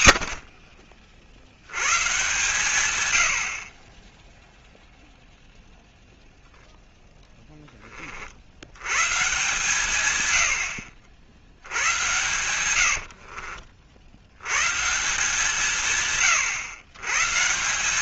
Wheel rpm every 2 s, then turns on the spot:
40, 130, 0, 0, 100, 80, 80, 150, 110.
12-14